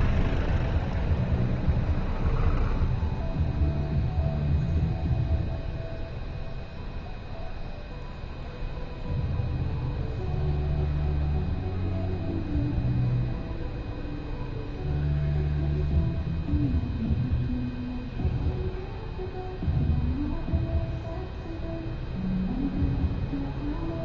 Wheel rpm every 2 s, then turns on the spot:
0, 0, 0, 0, 0, 0, 0, 0, 0, 0, 0, 0.
none